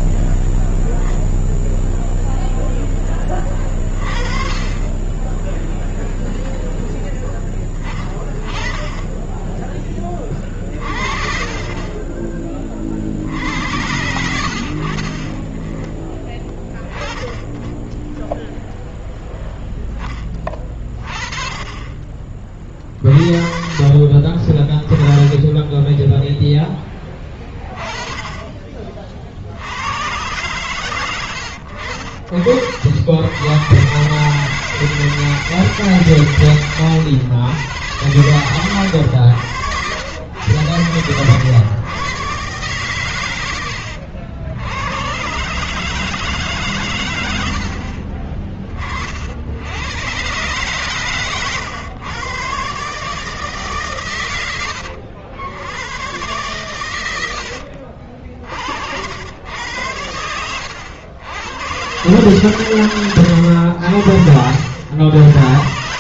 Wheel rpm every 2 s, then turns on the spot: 0, 0, 30, 0, 20, 40, 30, 70, 10, 0, 20, 30, 20, 10, 30, 120, 60, 150, 120, 110, 100, 130, 90, 150, 40, 120, 130, 110, 120, 60, 90, 130, 80.
24-26 28-30 40-42